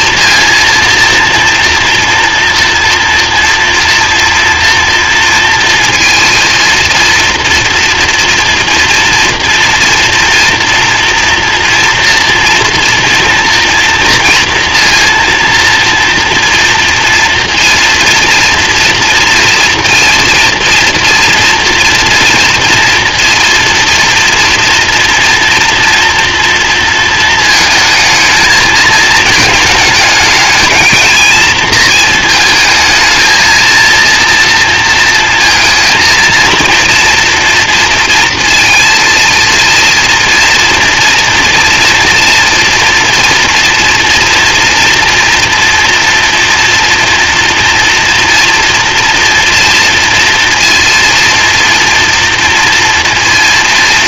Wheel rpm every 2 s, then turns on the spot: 230, 240, 230, 230, 240, 240, 230, 230, 230, 230, 230, 230, 230, 230, 220, 220, 220, 230, 230, 230, 230, 230, 240, 230, 230, 230, 230.
none